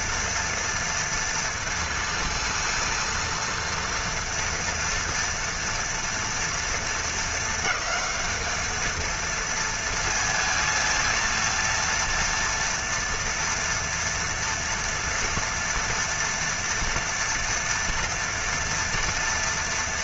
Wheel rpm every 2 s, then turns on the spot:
230, 230, 240, 230, 220, 230, 230, 230, 230, 230.
none